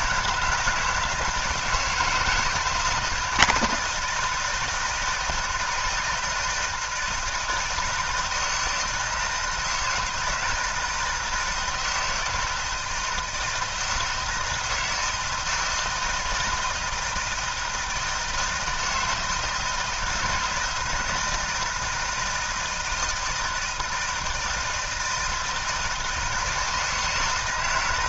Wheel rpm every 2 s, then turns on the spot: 160, 160, 160, 160, 170, 160, 160, 160, 160, 160, 160, 160, 160, 160.
none